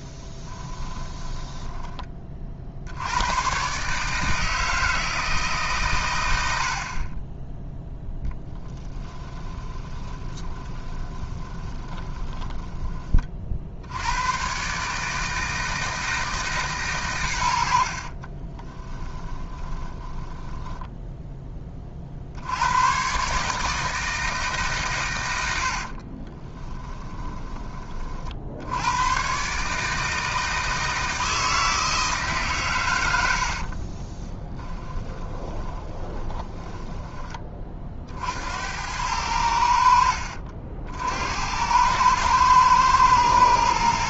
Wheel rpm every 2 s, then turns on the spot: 10, 80, 160, 40, 10, 20, 30, 150, 120, 10, 10, 130, 130, 20, 110, 160, 100, 20, 20, 90, 70, 110.
0-2 8-12 18-20 26-28 34-36